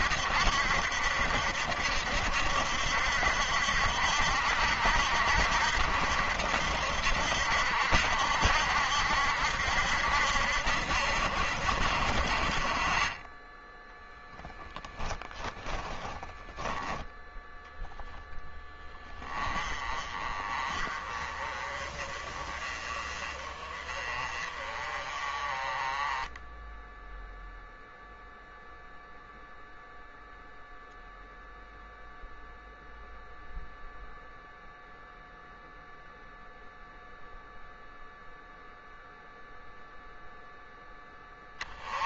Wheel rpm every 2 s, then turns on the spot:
70, 70, 70, 70, 70, 70, 30, 20, 20, 10, 30, 30, 30, 10, 0, 0, 0, 0, 0, 0, 10.
14-16